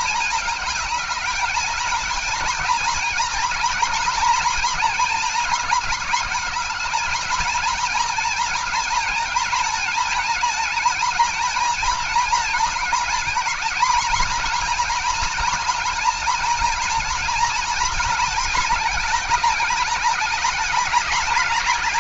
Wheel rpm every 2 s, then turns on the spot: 220, 230, 230, 220, 230, 230, 220, 240, 240, 220, 210.
none